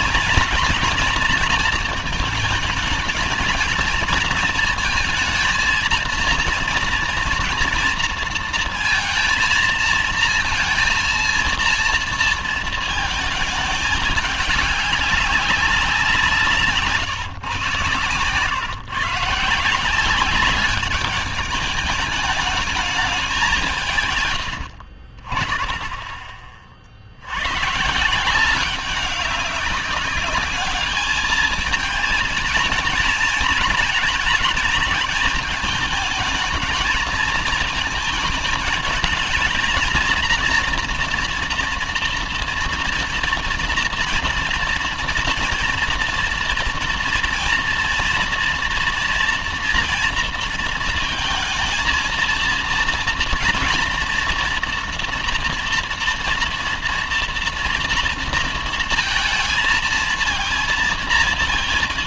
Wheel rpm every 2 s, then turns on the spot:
230, 220, 230, 230, 230, 230, 230, 200, 150, 130, 200, 210, 100, 40, 180, 210, 220, 220, 220, 220, 230, 240, 240, 240, 230, 230, 230, 230, 230, 230, 220.
24-26